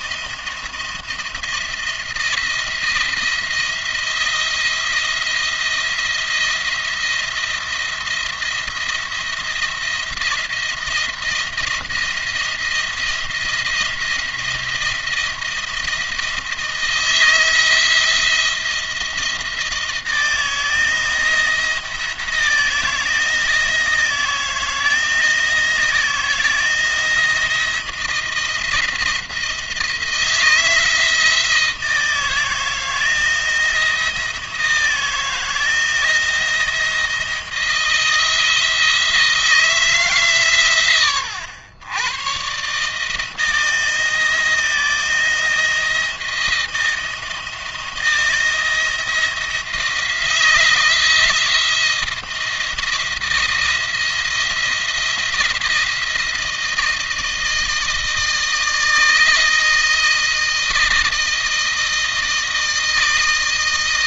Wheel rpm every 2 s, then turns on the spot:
170, 170, 170, 170, 170, 170, 170, 170, 170, 170, 160, 160, 160, 160, 170, 160, 160, 160, 160, 160, 130, 130, 160, 170, 170, 170, 170, 170, 170, 160, 160, 160.
none